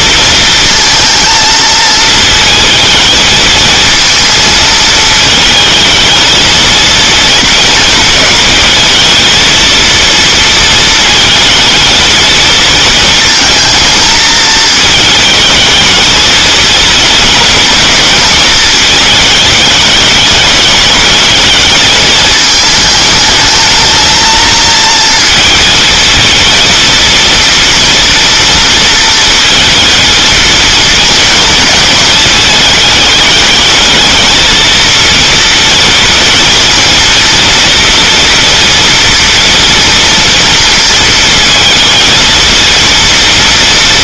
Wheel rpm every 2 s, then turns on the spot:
230, 220, 220, 230, 210, 230, 230, 220, 230, 220, 210, 220, 230, 230, 230, 230, 220, 230, 230, 240, 230, 230.
none